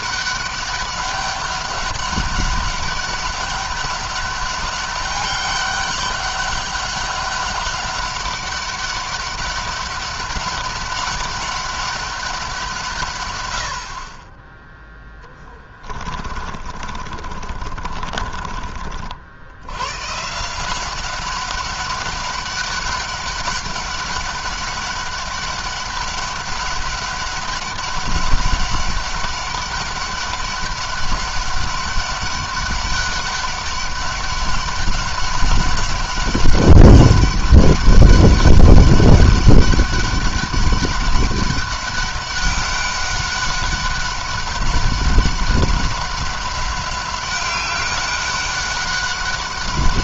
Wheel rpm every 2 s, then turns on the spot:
200, 200, 200, 200, 200, 200, 180, 10, 30, 40, 170, 200, 200, 200, 200, 200, 200, 200, 200, 200, 200, 200, 200, 200, 200.
16-18